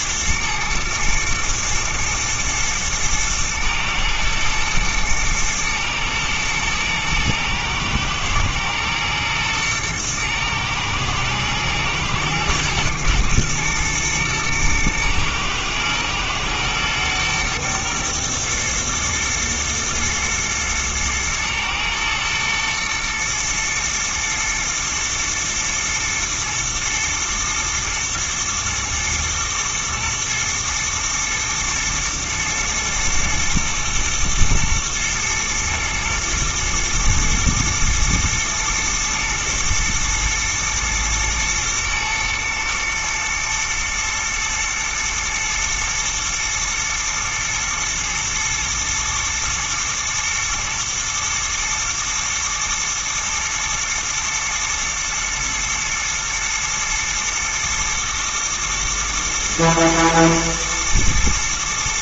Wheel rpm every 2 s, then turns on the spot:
110, 110, 110, 110, 110, 120, 110, 110, 120, 110, 110, 120, 120, 110, 120, 120, 110, 110, 110, 110, 110, 120, 120, 120, 120, 120, 120, 110, 110, 120, 120.
none